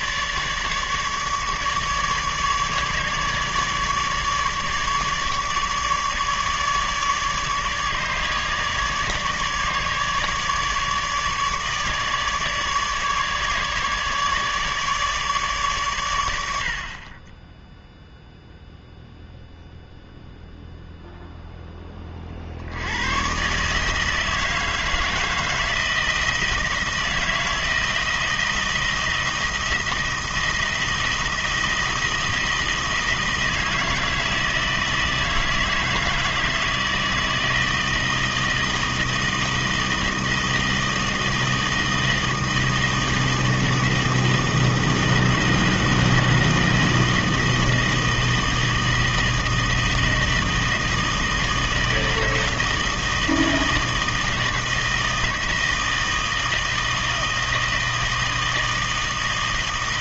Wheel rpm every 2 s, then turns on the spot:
150, 150, 150, 150, 150, 150, 150, 150, 70, 0, 0, 60, 160, 160, 160, 170, 160, 160, 160, 160, 160, 160, 160, 160, 160, 160, 160, 160, 160, 160.
none